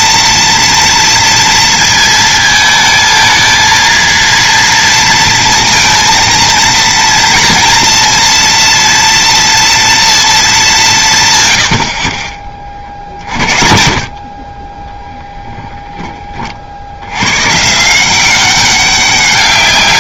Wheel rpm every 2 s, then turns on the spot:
230, 220, 230, 220, 230, 200, 30, 20, 50, 190.
none